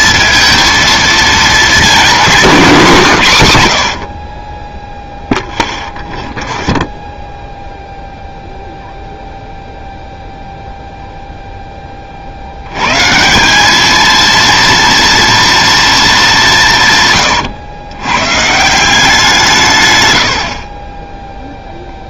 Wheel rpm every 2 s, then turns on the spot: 220, 170, 0, 10, 0, 0, 90, 230, 170, 160, 50.
6-8